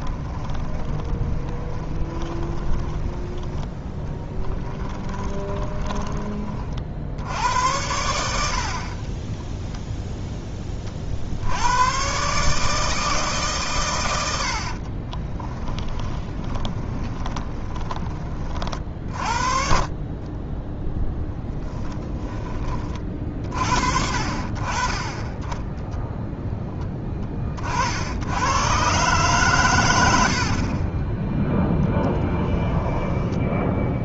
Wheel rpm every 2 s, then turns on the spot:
20, 20, 20, 50, 60, 30, 150, 50, 20, 40, 10, 30, 40, 10, 120, 40, 10.
0-6 16-18 20-22 30-34